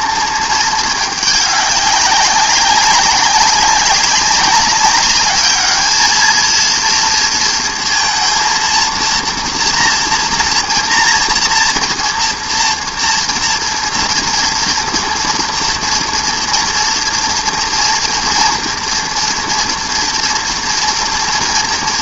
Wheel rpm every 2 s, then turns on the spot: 220, 200, 200, 230, 230, 230, 230, 230, 230, 230, 230.
none